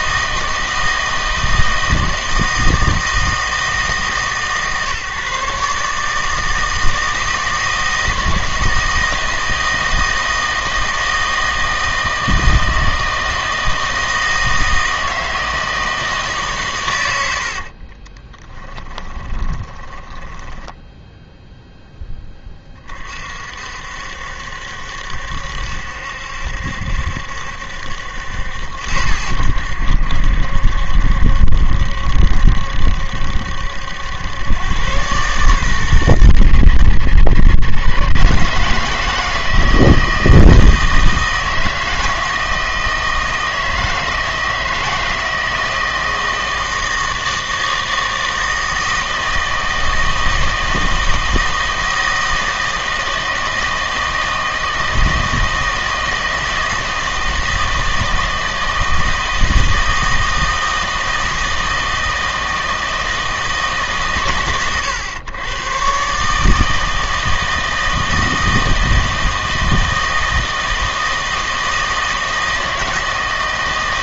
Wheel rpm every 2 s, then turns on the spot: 160, 160, 140, 160, 160, 160, 160, 160, 110, 10, 10, 30, 70, 70, 80, 70, 70, 110, 120, 150, 160, 160, 160, 160, 160, 160, 160, 160, 160, 160, 160, 160, 100, 160, 160, 160, 160.
18-22